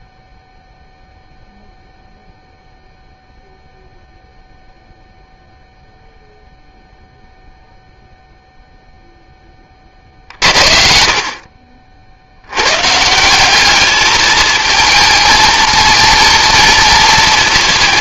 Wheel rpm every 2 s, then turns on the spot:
0, 0, 0, 0, 0, 50, 170, 230, 230.
none